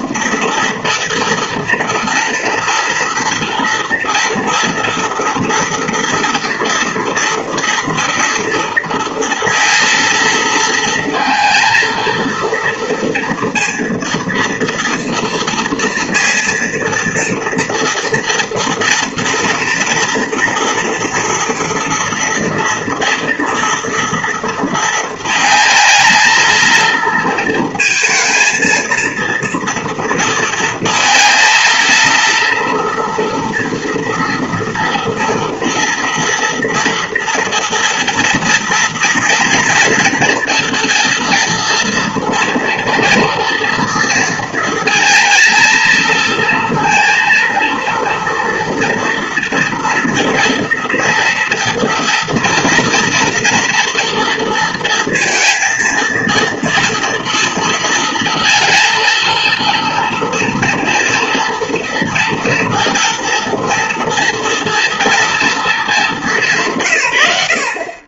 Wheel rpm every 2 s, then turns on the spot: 230, 230, 230, 230, 230, 230, 230, 230, 230, 230, 230, 230, 230, 230, 230, 230, 240, 230, 230, 230, 230, 230, 230, 230, 230, 240, 240, 230, 230, 230, 230, 240, 230, 170.
none